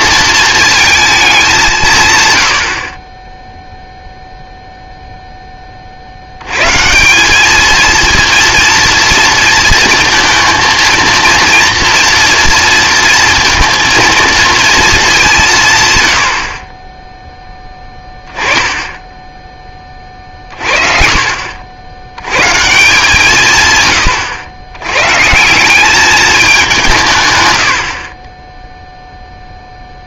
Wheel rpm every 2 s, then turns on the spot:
220, 80, 0, 130, 230, 230, 230, 230, 40, 20, 40, 150, 100, 180, 0.
none